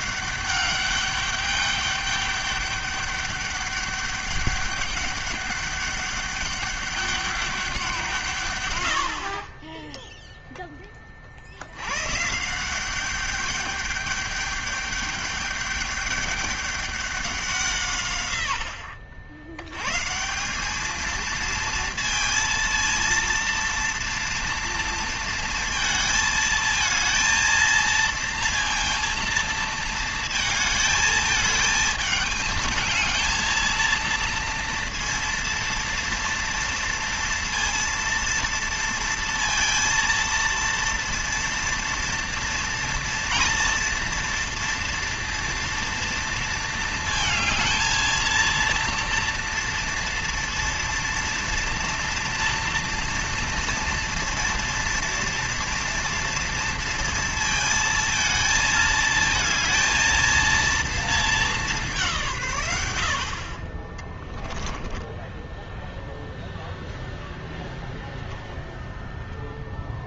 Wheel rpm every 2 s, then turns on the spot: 200, 200, 200, 200, 120, 10, 160, 200, 200, 90, 200, 230, 230, 220, 230, 220, 220, 230, 230, 230, 230, 230, 230, 230, 230, 230, 230, 230, 230, 220, 230, 140, 20, 0, 0.
64-66